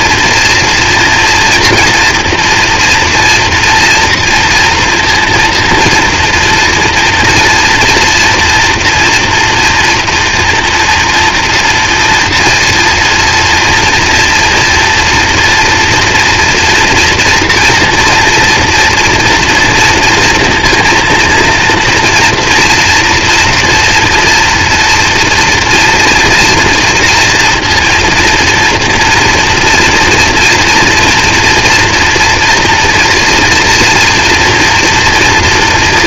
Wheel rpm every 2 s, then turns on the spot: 230, 240, 230, 240, 240, 240, 230, 230, 230, 230, 230, 230, 230, 230, 230, 240, 230, 240.
none